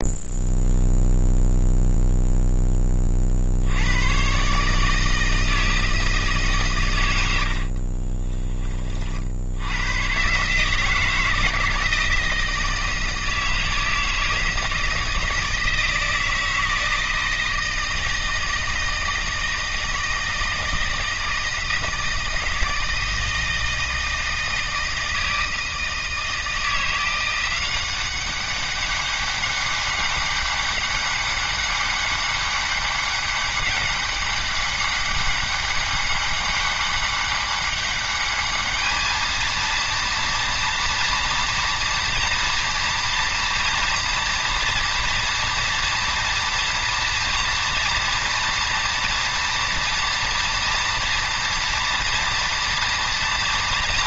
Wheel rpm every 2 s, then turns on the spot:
0, 10, 140, 130, 20, 140, 160, 160, 160, 160, 160, 160, 160, 160, 190, 200, 200, 200, 200, 210, 240, 230, 230, 230, 230, 230, 230.
none